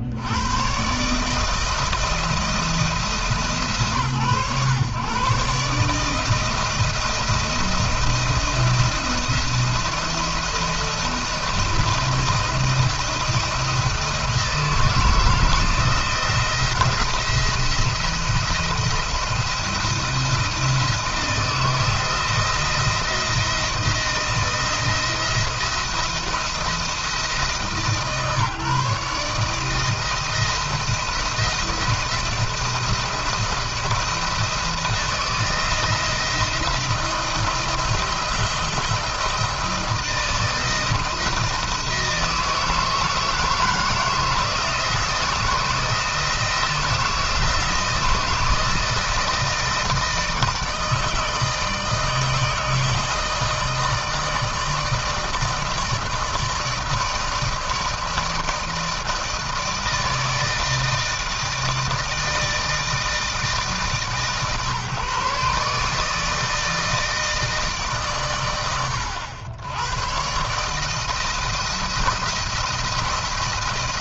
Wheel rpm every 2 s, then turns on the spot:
100, 170, 130, 160, 170, 170, 170, 160, 160, 170, 160, 170, 160, 170, 150, 170, 170, 160, 170, 160, 160, 160, 170, 170, 160, 160, 160, 160, 160, 160, 160, 160, 140, 160, 120, 130, 160.
none